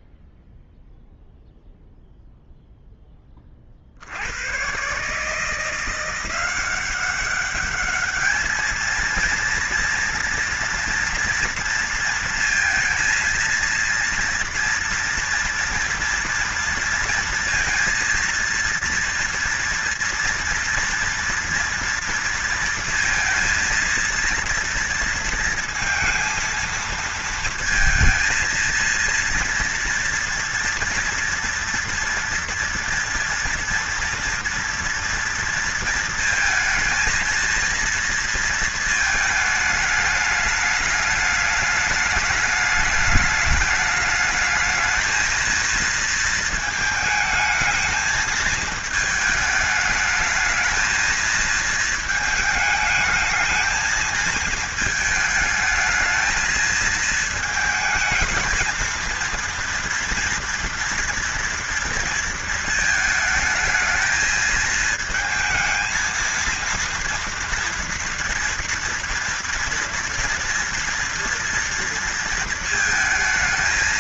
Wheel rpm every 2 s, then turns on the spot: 0, 0, 110, 180, 220, 230, 230, 230, 230, 230, 230, 230, 230, 230, 230, 230, 230, 230, 220, 220, 210, 210, 220, 220, 220, 220, 210, 220, 220, 220, 230, 220, 220, 230, 230, 230, 220.
none